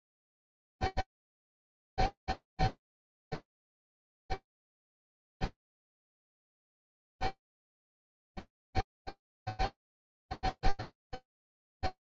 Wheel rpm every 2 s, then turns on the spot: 0, 0, 0, 0, 0, 0.
none